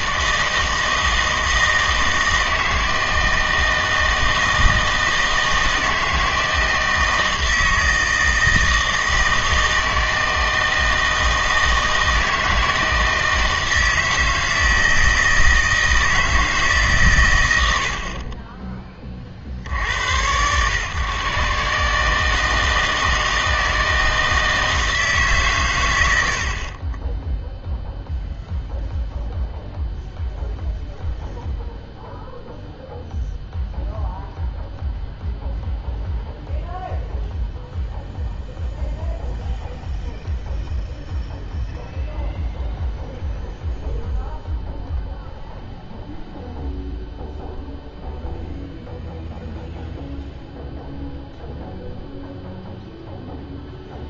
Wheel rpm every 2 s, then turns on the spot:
160, 160, 160, 160, 160, 160, 160, 160, 150, 20, 120, 160, 160, 40, 0, 0, 0, 0, 0, 0, 0, 0, 0, 0, 0, 0, 0.
none